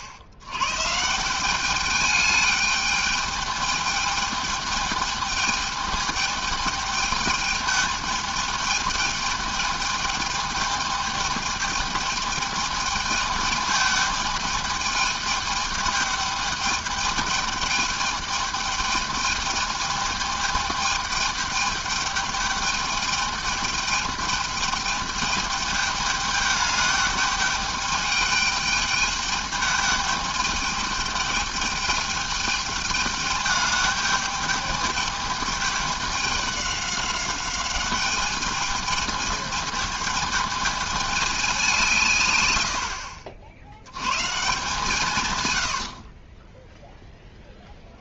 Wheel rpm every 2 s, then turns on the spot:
100, 210, 210, 210, 210, 210, 210, 210, 210, 210, 210, 210, 210, 210, 210, 210, 210, 210, 200, 210, 220, 100, 150, 10.
46-48